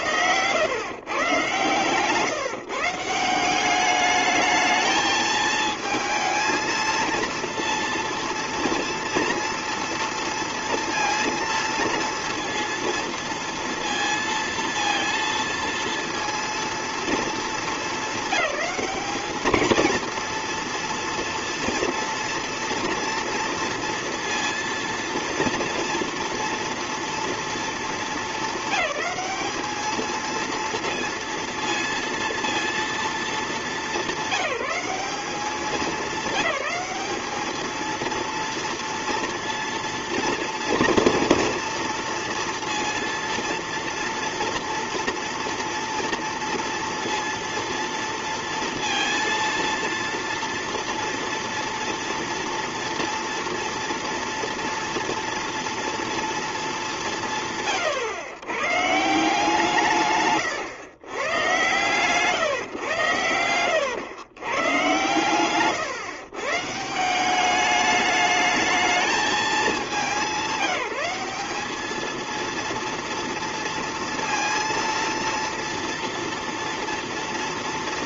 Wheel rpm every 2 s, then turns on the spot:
110, 150, 220, 230, 230, 230, 230, 230, 230, 200, 230, 230, 230, 230, 220, 230, 230, 200, 200, 230, 230, 230, 230, 230, 230, 230, 230, 230, 210, 110, 140, 130, 120, 160, 220, 190, 230, 230, 230.
none